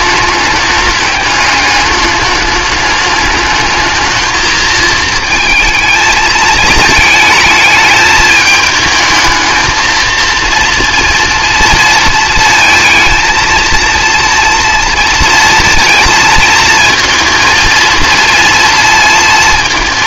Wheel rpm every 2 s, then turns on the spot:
210, 210, 220, 220, 210, 230, 230, 230, 230, 230.
none